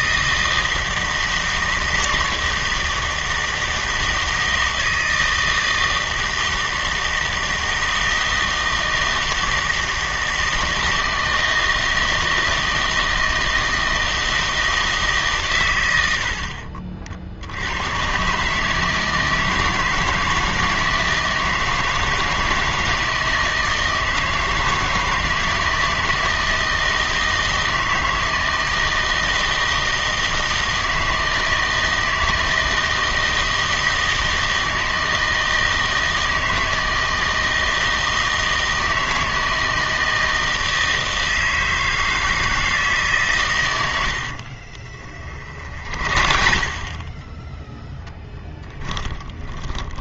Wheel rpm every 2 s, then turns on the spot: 160, 160, 160, 160, 160, 160, 160, 160, 40, 150, 160, 160, 160, 160, 160, 160, 160, 160, 160, 160, 160, 160, 50, 30, 10.
44-50